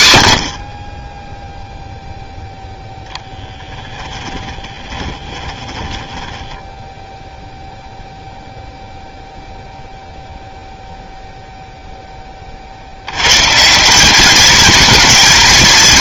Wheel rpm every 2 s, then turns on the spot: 30, 0, 20, 10, 0, 0, 140, 230.
4-8